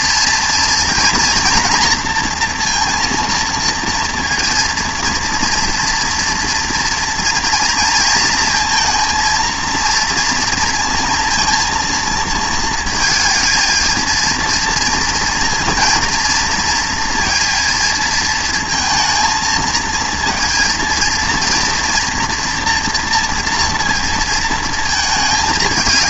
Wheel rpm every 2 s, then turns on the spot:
230, 230, 230, 230, 230, 230, 230, 230, 230, 230, 230, 230, 230.
none